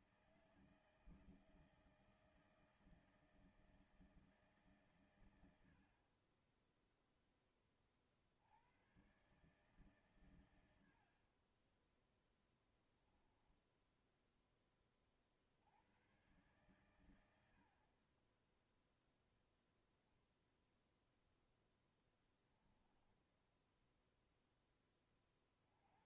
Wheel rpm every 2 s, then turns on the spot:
160, 160, 150, 30, 50, 130, 10, 10, 110, 30, 0, 10, 10.
12-14 18-20 22-24